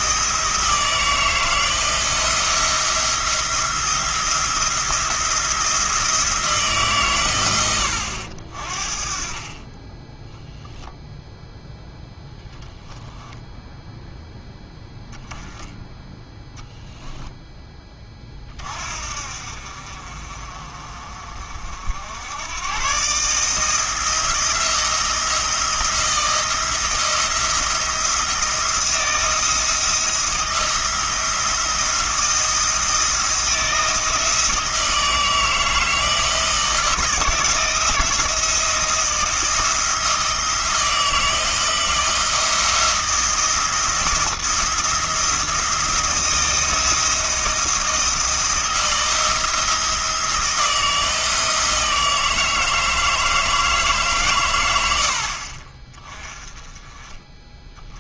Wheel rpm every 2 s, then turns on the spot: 160, 170, 170, 160, 40, 0, 10, 10, 0, 50, 50, 120, 170, 160, 170, 170, 160, 160, 160, 170, 160, 170, 170, 160, 170, 160, 160, 90, 20.
none